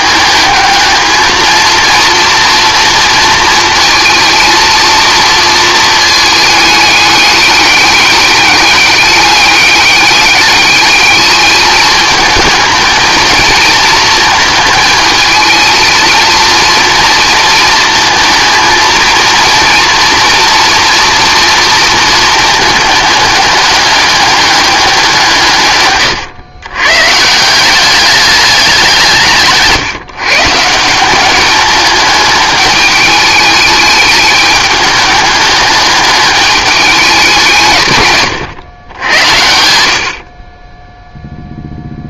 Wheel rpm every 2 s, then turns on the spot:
220, 230, 230, 210, 200, 200, 220, 220, 230, 220, 230, 210, 200, 120, 190, 160, 210, 210, 210, 130, 20.
none